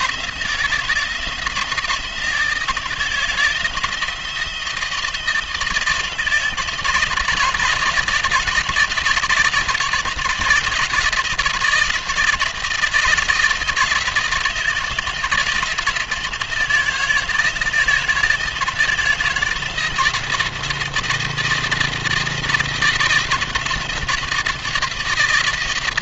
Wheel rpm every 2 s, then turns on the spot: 160, 160, 160, 160, 170, 170, 170, 160, 160, 160, 170, 170, 170.
none